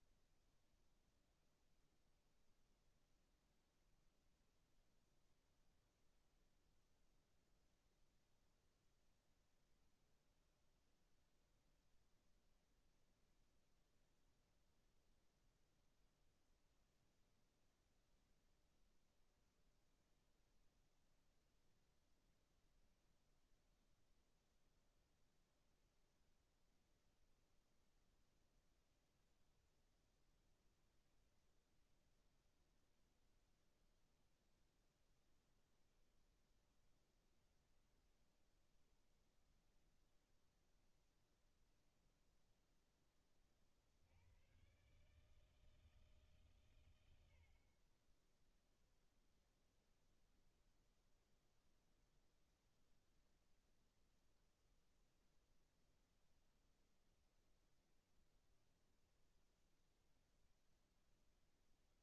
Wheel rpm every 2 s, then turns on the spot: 0, 0, 0, 0, 0, 0, 0, 0, 0, 0, 0, 0, 0, 0, 0, 0, 0, 0, 0, 0, 0, 0, 110, 140, 10, 0, 0, 0, 0, 0, 0.
none